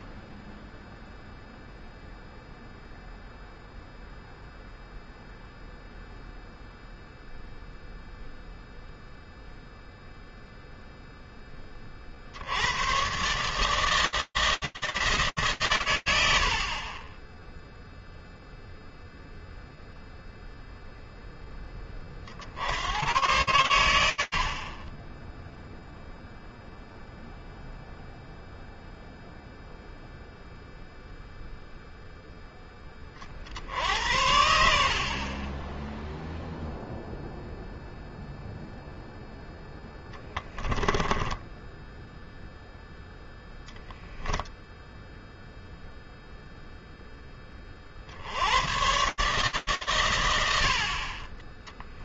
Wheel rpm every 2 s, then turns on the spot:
0, 0, 0, 0, 0, 0, 80, 160, 40, 0, 0, 100, 30, 0, 0, 0, 50, 20, 0, 0, 10, 0, 0, 20, 140, 20.
40-42